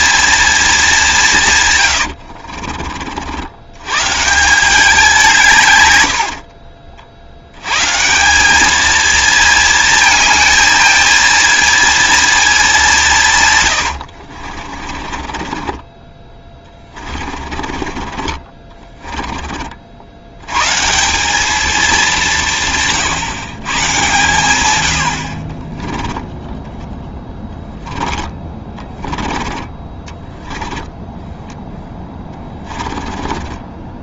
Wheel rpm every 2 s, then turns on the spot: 220, 40, 180, 50, 200, 220, 210, 50, 20, 30, 140, 150, 110, 10, 20, 10, 20.
2-4 6-8 14-20 26-34